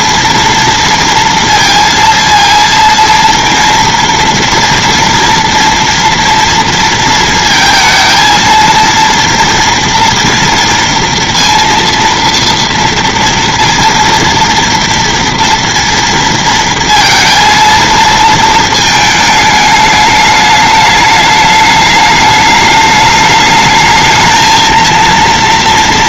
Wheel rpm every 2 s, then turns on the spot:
230, 230, 230, 230, 230, 230, 230, 230, 230, 220, 210, 210, 230.
none